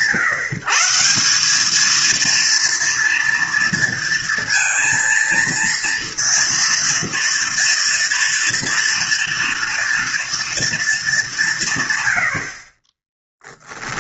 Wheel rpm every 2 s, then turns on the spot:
160, 230, 230, 230, 230, 230, 30.
none